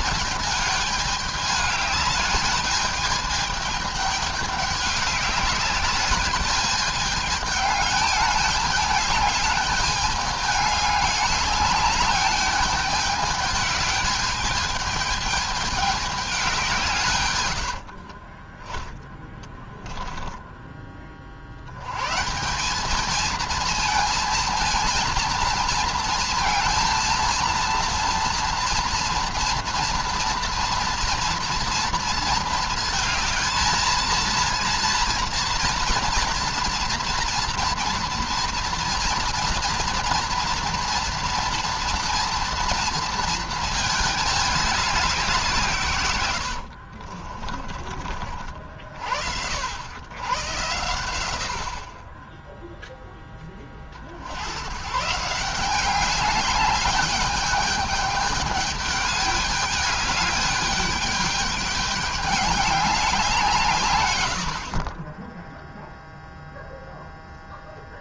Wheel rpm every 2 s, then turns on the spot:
210, 210, 210, 210, 210, 210, 210, 210, 170, 20, 10, 180, 230, 230, 230, 230, 220, 230, 230, 230, 230, 230, 200, 70, 40, 110, 0, 110, 200, 210, 210, 200, 50, 0.
46-48